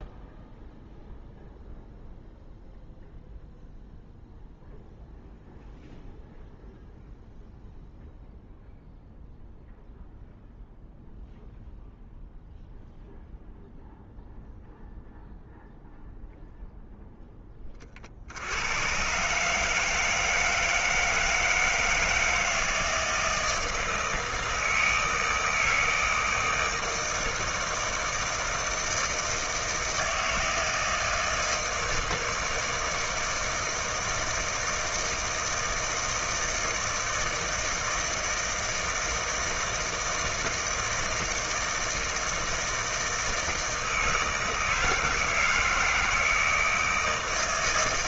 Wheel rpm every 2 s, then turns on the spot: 0, 0, 0, 0, 0, 0, 0, 0, 0, 90, 160, 160, 160, 160, 160, 160, 160, 160, 160, 160, 160, 160, 160, 160.
none